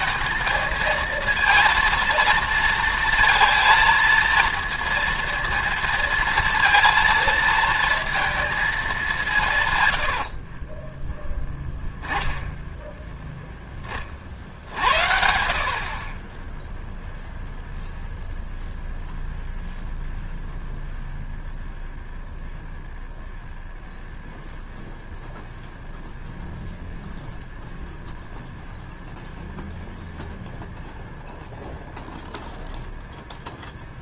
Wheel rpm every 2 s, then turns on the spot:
220, 230, 230, 230, 220, 40, 10, 60, 10, 0, 0, 0, 0, 0, 0, 0, 0.
10-12